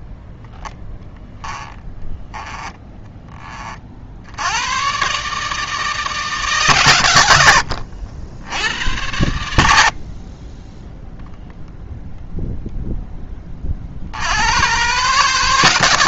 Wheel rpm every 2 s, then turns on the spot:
0, 20, 100, 130, 80, 10, 0, 80.
2-4 10-12